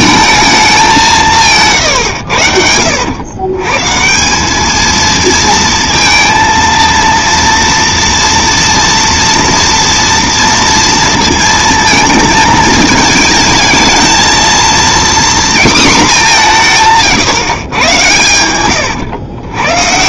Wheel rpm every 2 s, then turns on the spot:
200, 80, 210, 230, 230, 230, 220, 240, 160, 110.
18-20